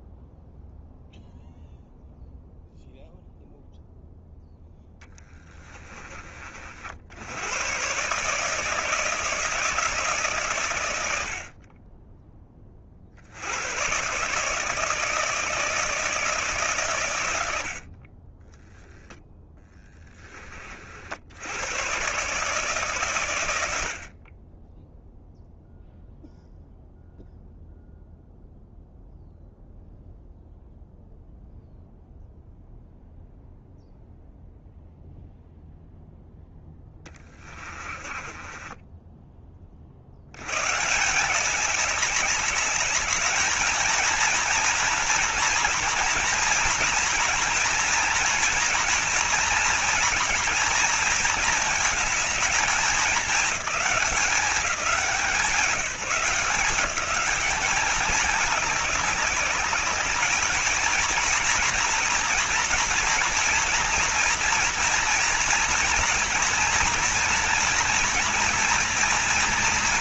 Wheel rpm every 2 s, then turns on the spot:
0, 0, 0, 50, 160, 120, 30, 150, 130, 10, 40, 140, 20, 0, 0, 0, 0, 0, 10, 20, 120, 210, 230, 240, 240, 230, 220, 200, 200, 200, 220, 240, 230, 240, 230.
18-20 36-40